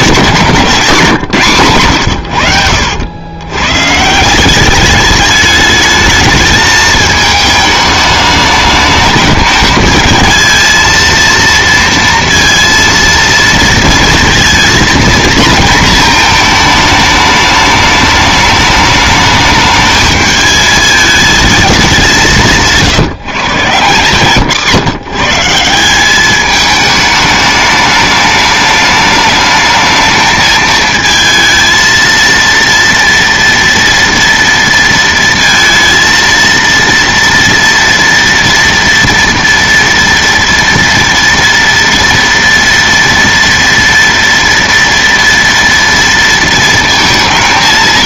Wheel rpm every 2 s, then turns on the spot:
160, 80, 190, 220, 210, 220, 230, 230, 220, 210, 210, 150, 140, 210, 210, 220, 230, 230, 230, 230, 230, 230, 230, 230.
2-4 22-24